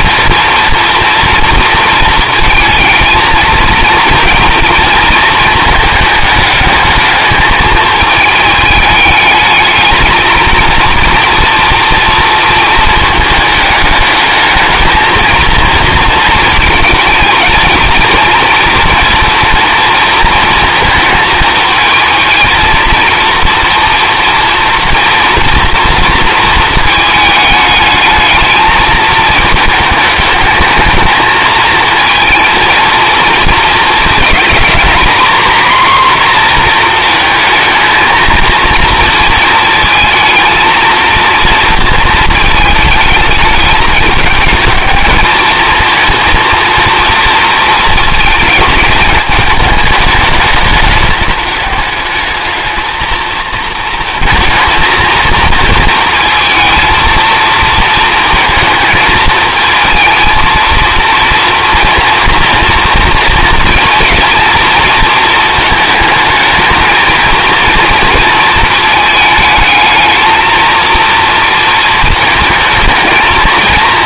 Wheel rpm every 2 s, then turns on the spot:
230, 230, 230, 220, 210, 230, 220, 220, 220, 230, 230, 230, 230, 220, 220, 220, 230, 230, 240, 230, 230, 220, 210, 230, 220, 220, 220, 230, 220, 220, 230, 230, 230, 220, 220, 230, 220.
none